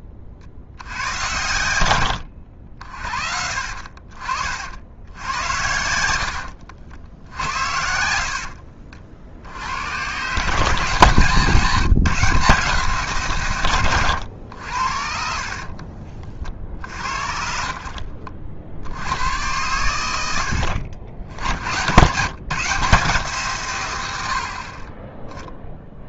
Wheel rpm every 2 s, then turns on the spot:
50, 70, 60, 70, 60, 150, 150, 70, 50, 60, 70, 150, 50.
none